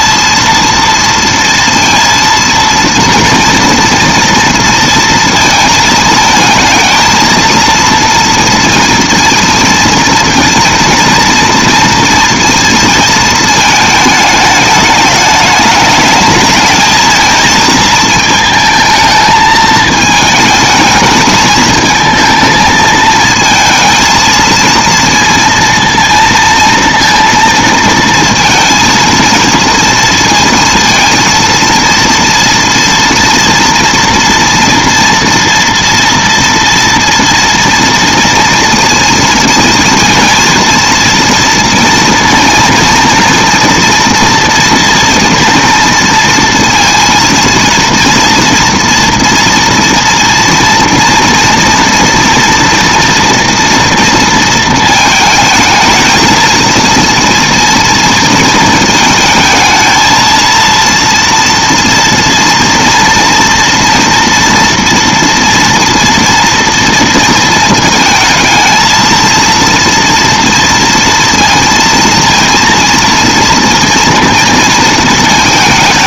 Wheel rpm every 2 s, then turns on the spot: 230, 230, 230, 220, 230, 230, 230, 210, 220, 220, 220, 220, 230, 230, 230, 230, 230, 230, 230, 230, 230, 230, 230, 230, 230, 230, 230, 220, 230, 220, 230, 230, 230, 230, 220, 230, 230, 230.
none